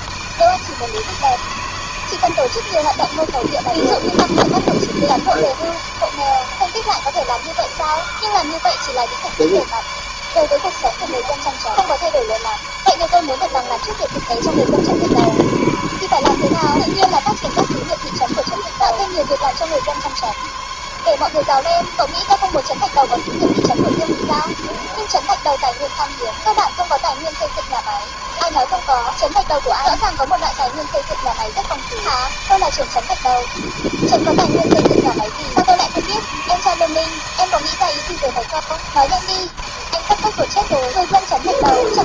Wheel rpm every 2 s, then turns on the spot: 160, 160, 160, 150, 150, 150, 150, 140, 140, 140, 140, 140, 140, 140, 140, 140, 150, 160, 160, 160, 160.
none